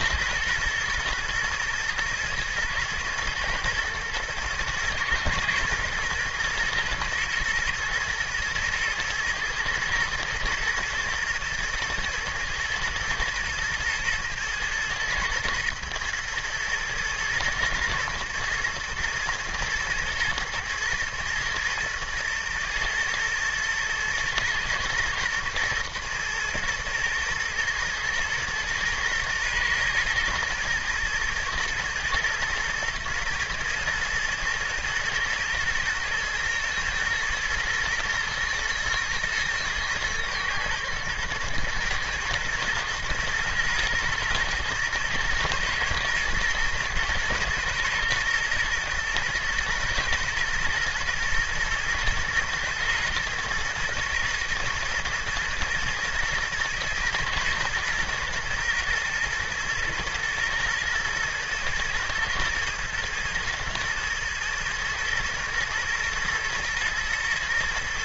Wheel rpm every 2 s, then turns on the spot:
110, 110, 110, 120, 110, 120, 110, 120, 110, 120, 110, 110, 120, 120, 120, 120, 120, 120, 110, 110, 120, 120, 120, 110, 120, 120, 120, 120, 110, 120, 110, 110, 110, 120.
none